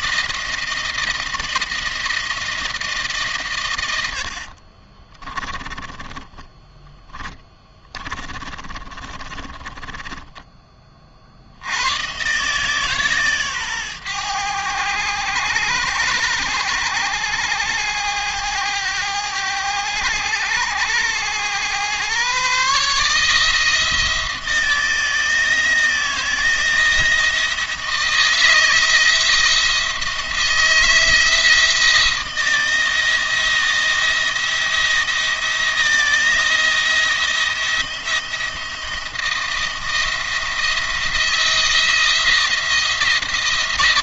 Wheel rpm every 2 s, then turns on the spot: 160, 160, 40, 10, 30, 20, 140, 100, 100, 100, 100, 140, 160, 160, 160, 160, 170, 170, 170, 170, 170, 170.
4-10